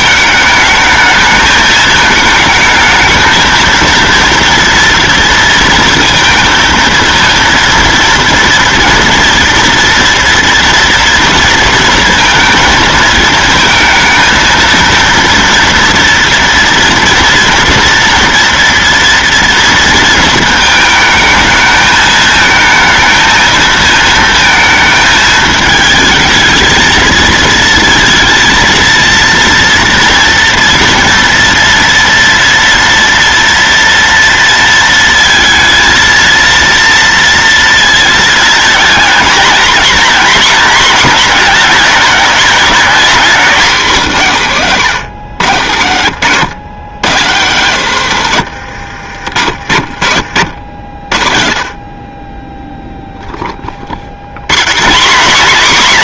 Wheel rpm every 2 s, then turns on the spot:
210, 220, 230, 230, 230, 230, 230, 230, 230, 230, 220, 220, 220, 220, 230, 230, 230, 230, 230, 230, 240, 230, 180, 160, 90, 80, 0, 170.
48-50